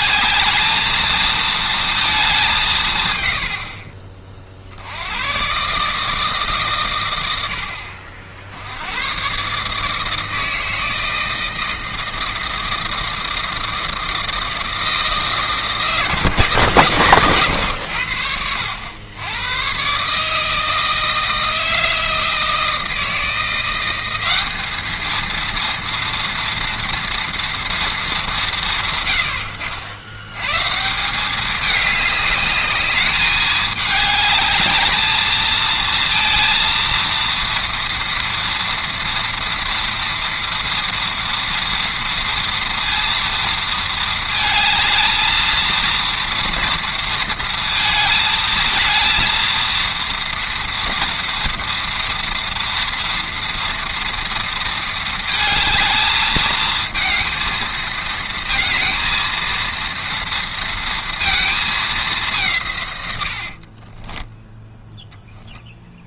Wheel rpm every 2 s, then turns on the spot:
220, 150, 60, 140, 70, 160, 160, 160, 130, 90, 160, 160, 210, 230, 160, 150, 210, 210, 230, 230, 240, 230, 220, 230, 220, 230, 240, 230, 220, 230, 230, 150, 10.
64-66